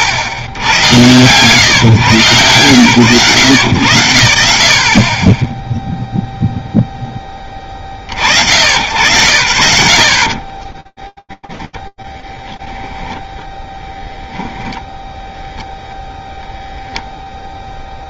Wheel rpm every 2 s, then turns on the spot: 90, 110, 60, 0, 90, 20, 10, 0, 0.
10-12